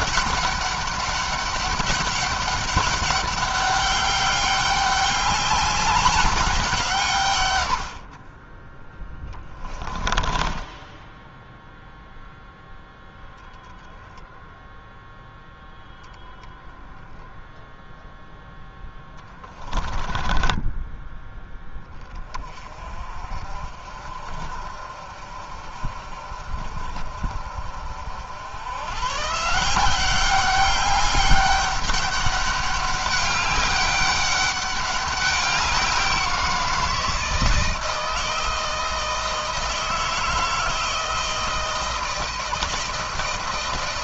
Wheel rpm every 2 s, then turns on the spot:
200, 200, 200, 170, 20, 10, 0, 0, 0, 10, 10, 30, 50, 50, 110, 200, 200, 200, 170, 170, 160, 160.
10-12 18-22